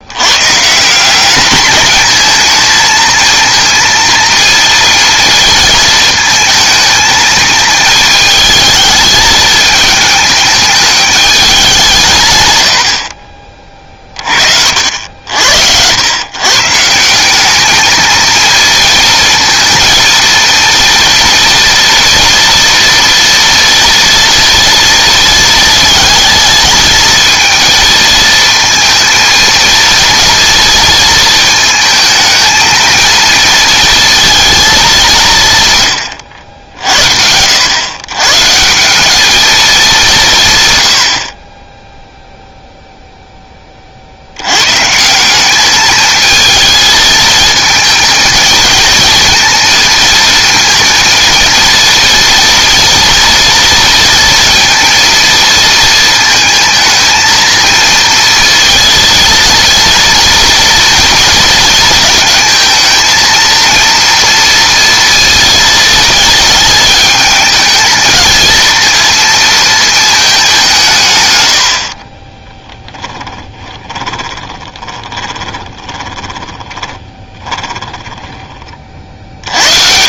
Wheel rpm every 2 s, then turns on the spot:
160, 220, 230, 220, 220, 210, 90, 60, 150, 230, 230, 230, 230, 220, 230, 230, 220, 210, 80, 170, 110, 0, 130, 220, 220, 230, 230, 230, 220, 230, 230, 230, 230, 220, 230, 180, 10, 20, 20, 40.
72-78